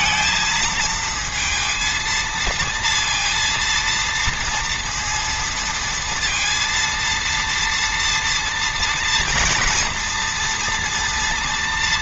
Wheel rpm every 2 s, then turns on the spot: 220, 230, 230, 230, 230, 240.
none